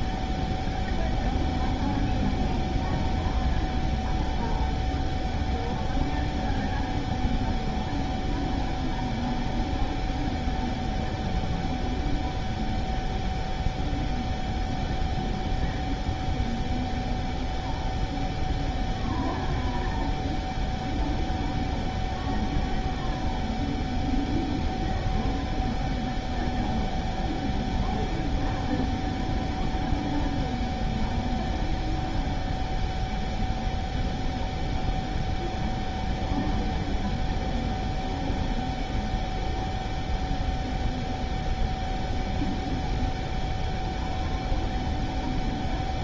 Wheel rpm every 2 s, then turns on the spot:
0, 0, 0, 0, 0, 0, 0, 0, 0, 0, 0, 0, 0, 0, 0, 0, 0, 0, 0, 0, 0, 0, 0.
none